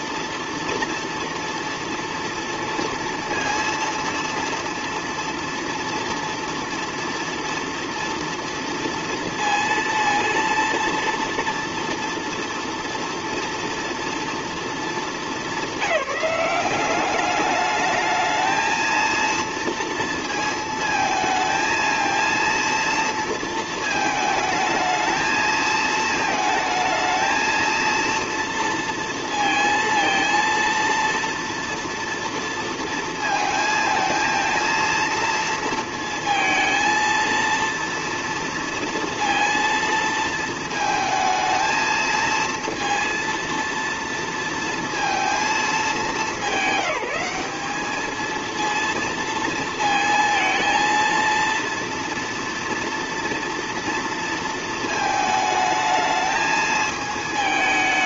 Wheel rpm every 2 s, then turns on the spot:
230, 230, 230, 230, 230, 230, 230, 220, 190, 220, 230, 230, 220, 220, 230, 230, 230, 230, 230, 230, 220, 230, 230, 200, 230, 230, 230, 220, 220.
none